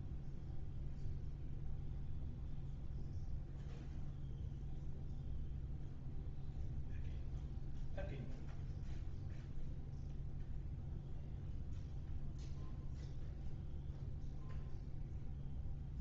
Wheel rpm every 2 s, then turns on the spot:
0, 0, 0, 0, 0, 0, 0, 0.
none